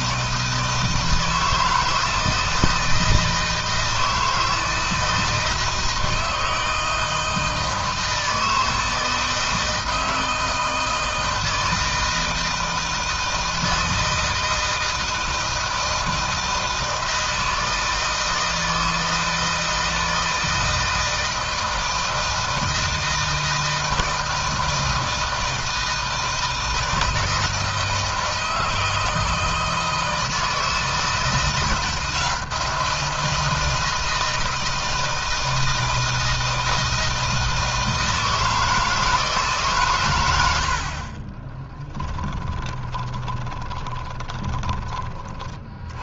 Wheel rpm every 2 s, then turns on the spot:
160, 160, 160, 160, 160, 160, 160, 160, 160, 160, 160, 160, 160, 160, 160, 160, 170, 160, 160, 160, 40, 10, 20.
42-44